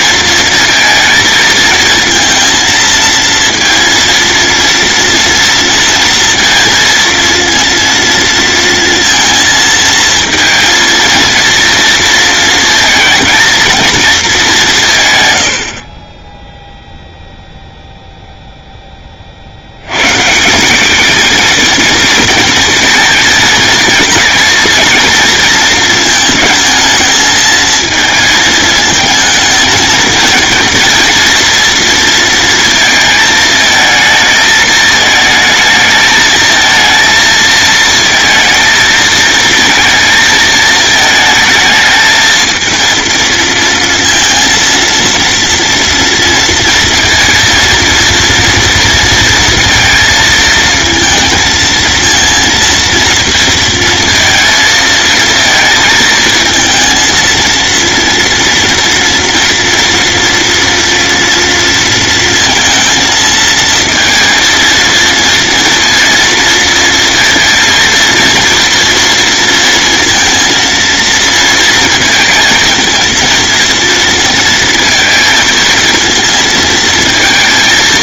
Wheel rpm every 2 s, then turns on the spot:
230, 230, 230, 230, 230, 230, 220, 110, 0, 20, 200, 230, 230, 220, 220, 230, 230, 220, 230, 230, 220, 230, 230, 230, 230, 230, 230, 230, 230, 230, 230, 230, 230, 230, 230, 230, 230, 230, 230.
none